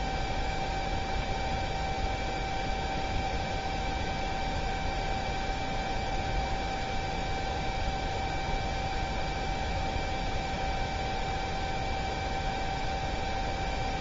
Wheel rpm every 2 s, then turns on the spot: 0, 0, 0, 0, 0, 0, 0.
none